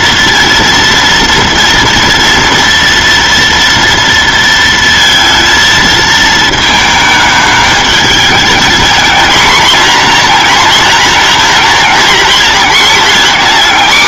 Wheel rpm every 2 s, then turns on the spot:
230, 230, 230, 220, 220, 240, 230.
none